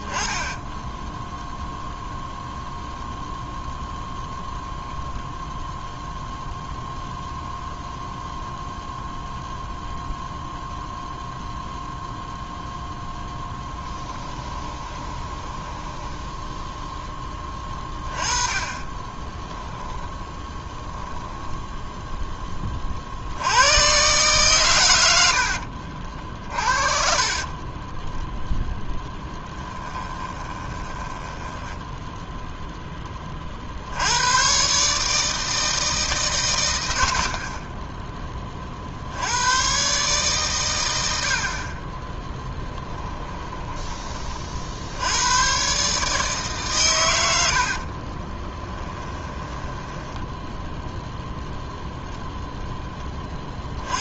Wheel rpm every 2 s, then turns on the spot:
10, 0, 0, 0, 0, 0, 0, 20, 10, 20, 10, 50, 100, 40, 10, 10, 10, 140, 90, 50, 100, 10, 80, 120, 20, 0, 10.
0-2 14-16 18-20 26-32 42-44 48-50